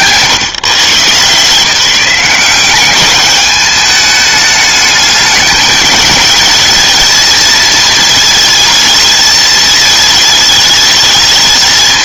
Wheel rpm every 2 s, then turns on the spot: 140, 180, 210, 220, 220, 210.
none